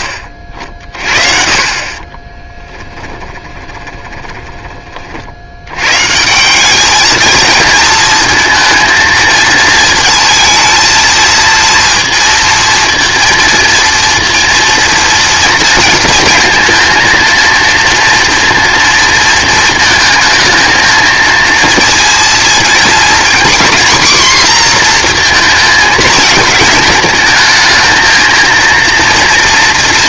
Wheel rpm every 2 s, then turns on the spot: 40, 10, 30, 200, 230, 230, 230, 230, 230, 230, 230, 230, 240, 220, 230.
2-4